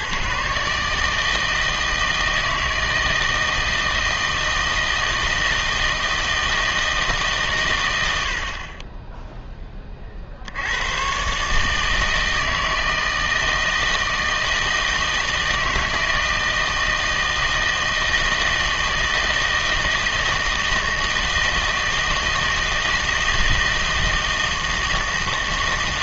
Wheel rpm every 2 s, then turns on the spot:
150, 160, 160, 160, 30, 90, 160, 160, 160, 160, 160, 160, 160.
none